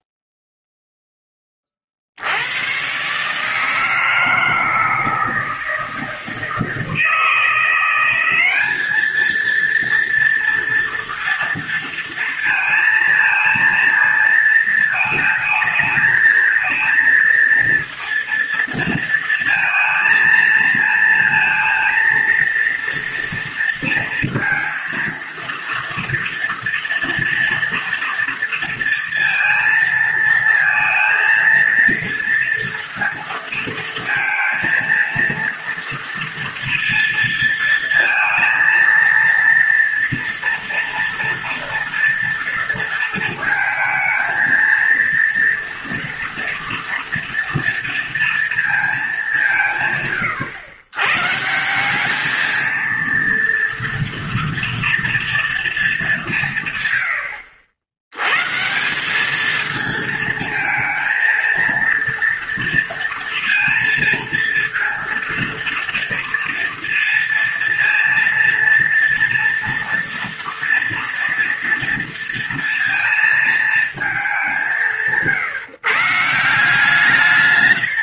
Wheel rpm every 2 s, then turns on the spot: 0, 100, 160, 160, 200, 230, 230, 230, 220, 230, 220, 230, 230, 230, 230, 230, 230, 230, 230, 230, 230, 230, 230, 230, 220, 100, 230, 230, 130, 160, 230, 230, 230, 230, 230, 230, 230, 180, 160.
none